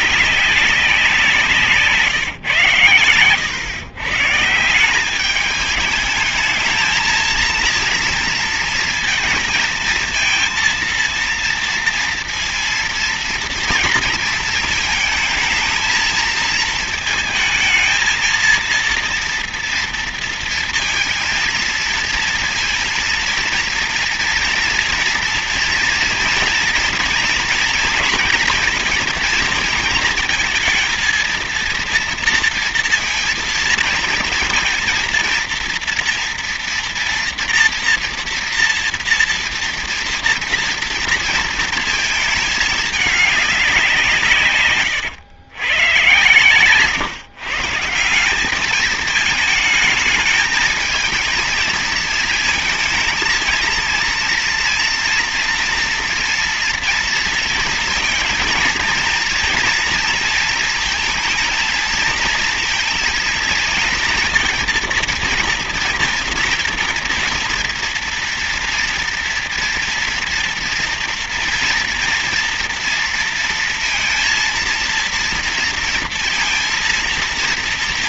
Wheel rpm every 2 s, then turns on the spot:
200, 120, 150, 220, 230, 230, 230, 220, 220, 230, 230, 230, 230, 230, 230, 230, 230, 230, 230, 230, 230, 220, 130, 120, 200, 220, 230, 230, 230, 220, 230, 230, 230, 230, 230, 230, 230, 230, 230.
44-46